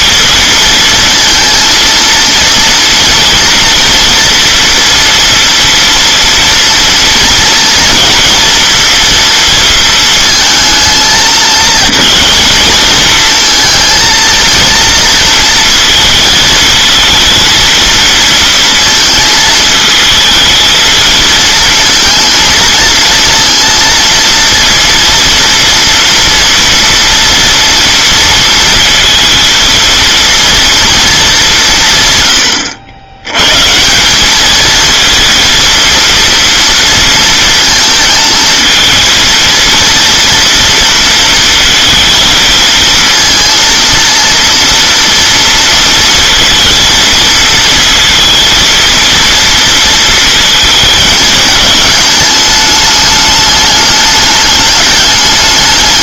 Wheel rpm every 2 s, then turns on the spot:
230, 230, 230, 230, 230, 220, 230, 230, 230, 230, 230, 230, 230, 230, 230, 230, 90, 220, 230, 220, 230, 220, 230, 230, 230, 220, 210, 210.
none